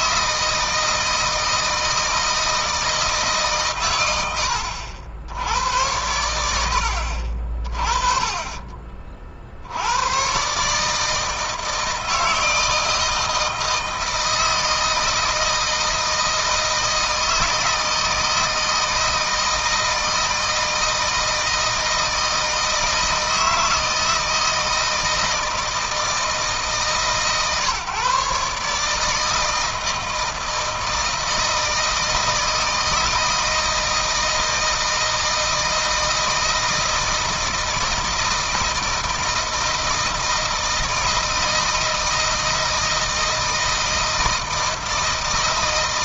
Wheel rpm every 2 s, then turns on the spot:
160, 160, 90, 80, 30, 140, 160, 160, 160, 160, 160, 160, 160, 160, 150, 160, 160, 160, 160, 160, 160, 160, 160.
none